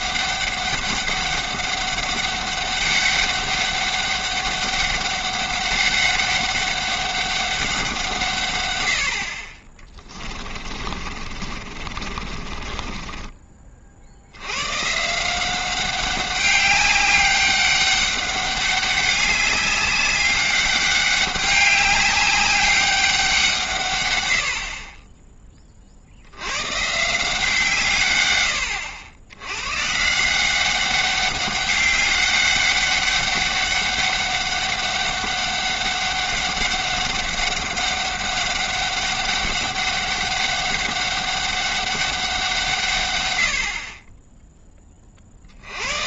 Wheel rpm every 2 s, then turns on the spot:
200, 200, 200, 200, 110, 30, 30, 120, 200, 200, 200, 200, 50, 120, 90, 190, 200, 200, 200, 200, 200, 150, 10.
10-14